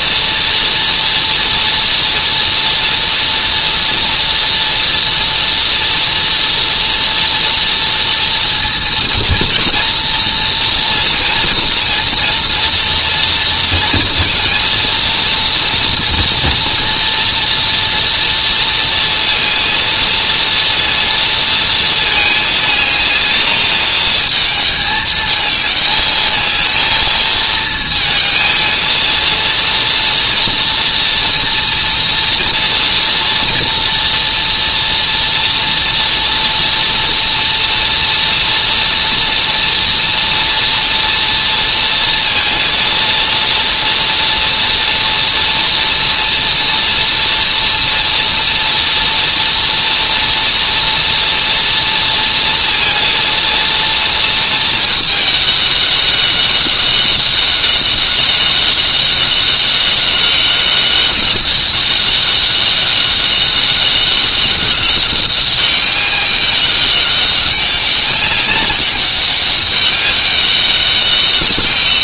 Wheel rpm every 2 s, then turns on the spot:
240, 230, 230, 230, 230, 230, 230, 230, 230, 230, 230, 220, 220, 220, 230, 230, 230, 230, 240, 240, 230, 230, 240, 230, 230, 230, 230, 220, 190, 200, 190, 200, 200, 190, 200, 190.
none